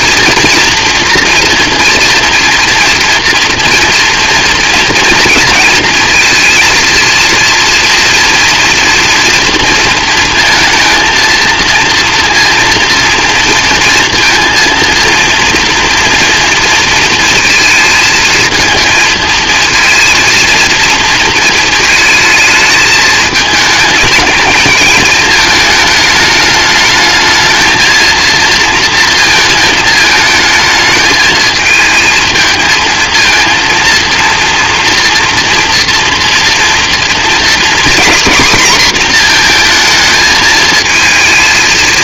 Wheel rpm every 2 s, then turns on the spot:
230, 230, 230, 230, 230, 230, 230, 230, 230, 220, 230, 220, 220, 220, 230, 220, 230, 240, 240, 240, 230.
none